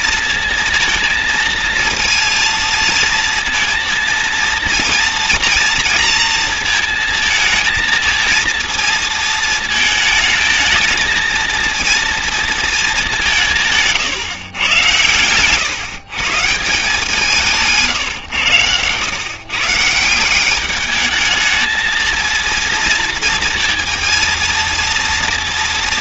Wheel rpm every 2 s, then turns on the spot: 230, 230, 230, 230, 230, 220, 230, 120, 160, 110, 190, 230, 230.
none